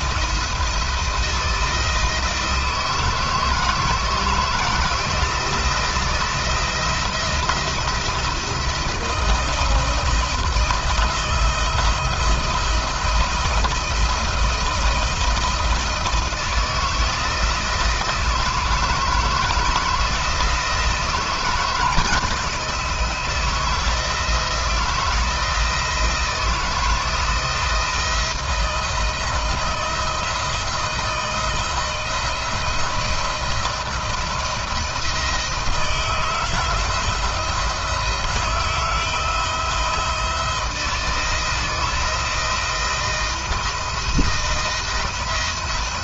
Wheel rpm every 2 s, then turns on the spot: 170, 160, 160, 170, 160, 160, 160, 170, 160, 160, 160, 160, 170, 170, 170, 170, 170, 160, 170, 160, 160, 170, 170.
none